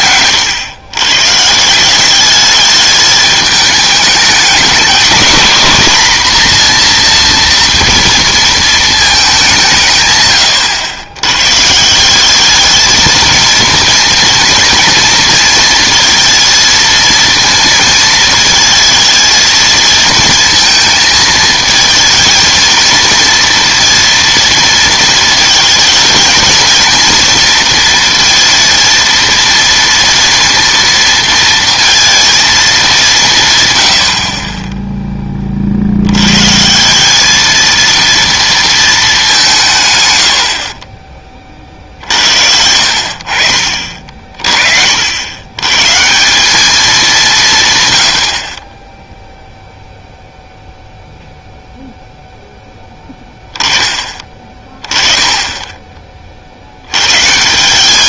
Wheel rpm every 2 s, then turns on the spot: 110, 210, 220, 240, 220, 100, 210, 230, 230, 220, 230, 230, 230, 230, 230, 230, 220, 20, 150, 230, 50, 60, 50, 210, 30, 0, 0, 20, 80.
none